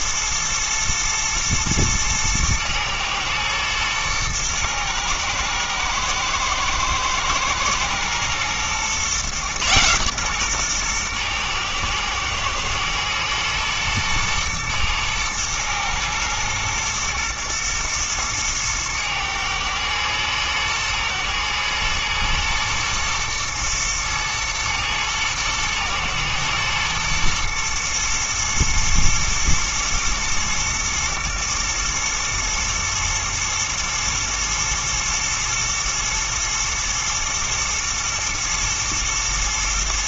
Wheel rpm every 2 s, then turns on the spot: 110, 110, 120, 120, 120, 120, 120, 110, 110, 110, 110, 120, 110, 110, 110, 110, 110, 120, 120, 110.
none